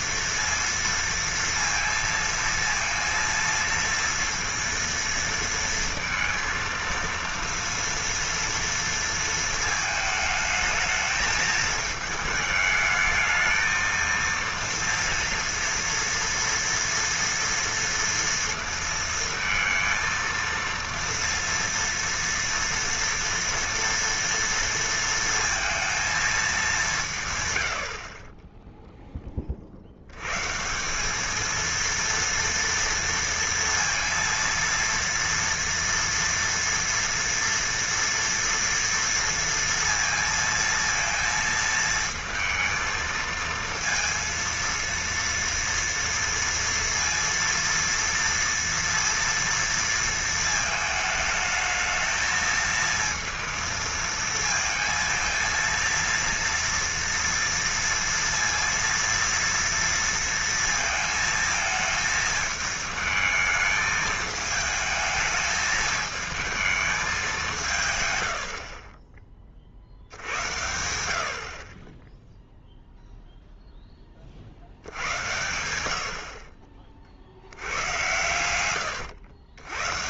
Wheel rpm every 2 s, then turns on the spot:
230, 230, 230, 230, 230, 220, 220, 230, 230, 230, 230, 240, 230, 210, 10, 150, 230, 230, 230, 230, 230, 230, 230, 230, 230, 220, 220, 230, 230, 230, 230, 220, 220, 220, 60, 90, 0, 60, 50, 110.
none